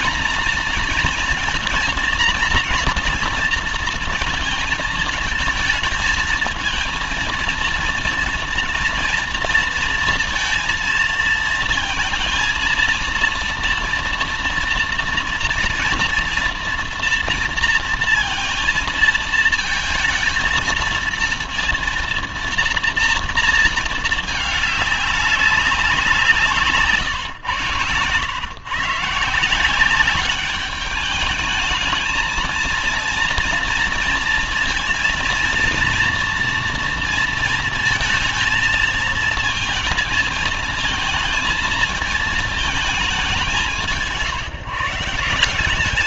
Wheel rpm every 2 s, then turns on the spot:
230, 230, 230, 220, 230, 230, 230, 230, 230, 230, 230, 230, 210, 170, 110, 200, 220, 230, 230, 220, 220, 220, 160.
26-28